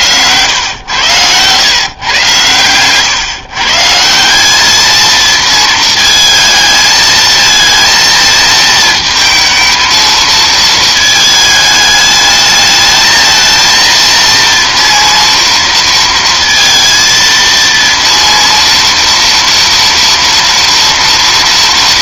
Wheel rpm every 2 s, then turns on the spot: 110, 120, 200, 220, 220, 220, 220, 230, 230, 230, 230.
none